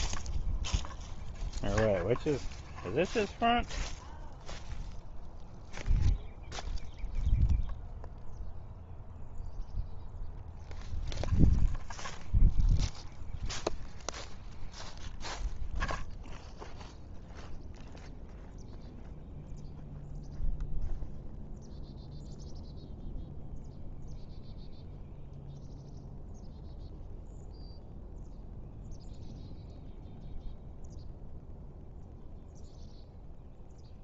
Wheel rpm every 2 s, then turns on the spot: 0, 0, 0, 0, 0, 0, 0, 0, 0, 0, 0, 0, 0, 0, 0, 0, 0.
none